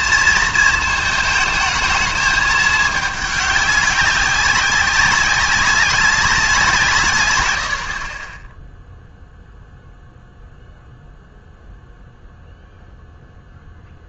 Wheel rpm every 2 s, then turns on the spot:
220, 210, 190, 170, 10, 0, 0.
none